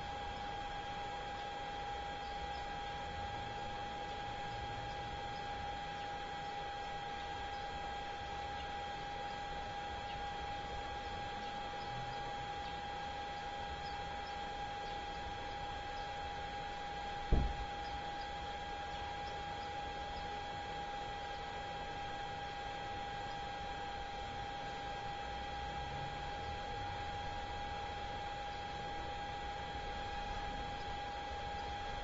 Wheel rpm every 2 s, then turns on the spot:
0, 0, 0, 0, 0, 0, 0, 0, 0, 0, 0, 0, 0, 0, 0, 0.
none